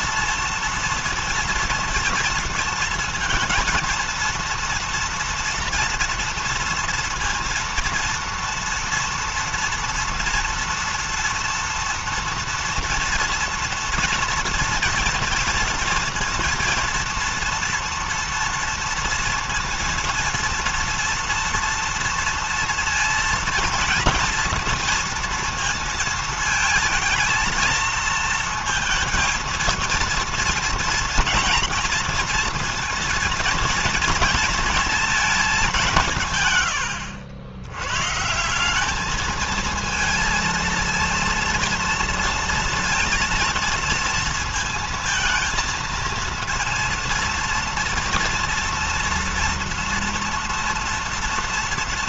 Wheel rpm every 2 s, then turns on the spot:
230, 230, 230, 230, 230, 230, 230, 230, 230, 230, 230, 230, 230, 220, 230, 230, 230, 230, 110, 200, 230, 230, 230, 230, 230, 230.
none